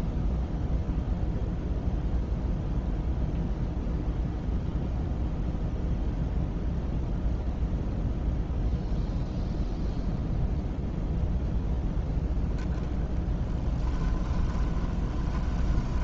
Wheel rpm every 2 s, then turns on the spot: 0, 0, 0, 0, 0, 0, 10, 20.
14-16